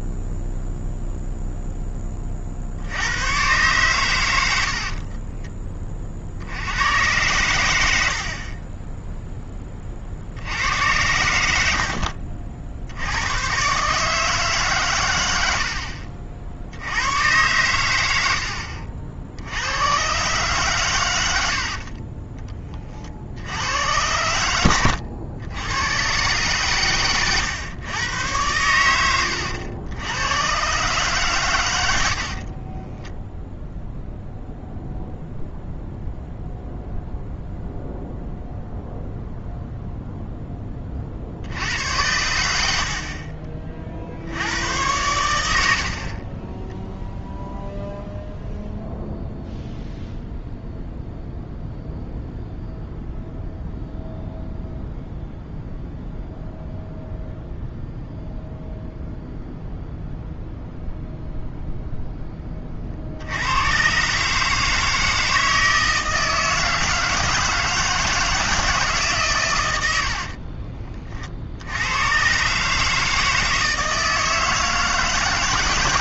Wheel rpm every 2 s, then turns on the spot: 0, 50, 70, 80, 30, 80, 50, 140, 60, 70, 130, 30, 100, 130, 100, 130, 30, 0, 0, 0, 30, 70, 90, 20, 0, 0, 0, 0, 0, 0, 0, 30, 150, 160, 160, 40, 140, 160.
8-10 32-34 70-72